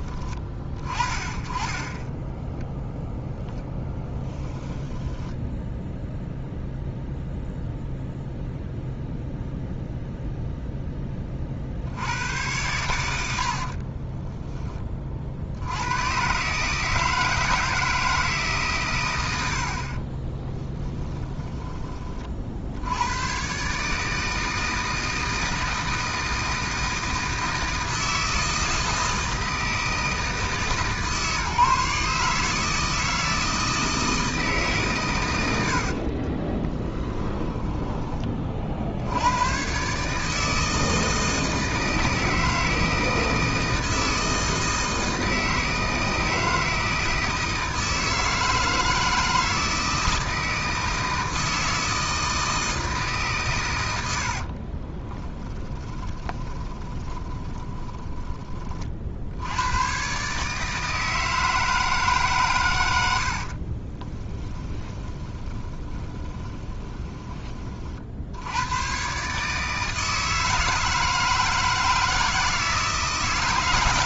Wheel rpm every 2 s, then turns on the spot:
30, 0, 10, 0, 0, 0, 100, 30, 150, 130, 10, 80, 160, 160, 160, 150, 160, 130, 20, 70, 160, 160, 160, 160, 160, 160, 160, 30, 20, 40, 160, 90, 20, 20, 120, 160, 150.
4-6 20-22 36-38 54-58 64-68